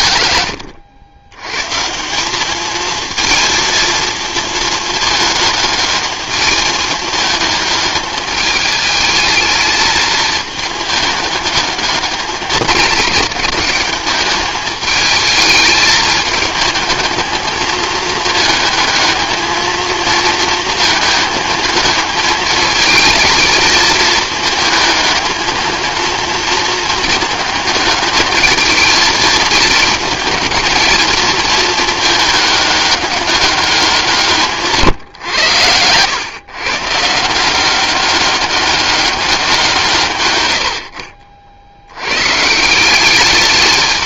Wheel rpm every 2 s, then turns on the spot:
90, 220, 220, 220, 210, 210, 220, 220, 220, 220, 220, 220, 220, 220, 220, 220, 200, 140, 140, 200, 60, 190.
none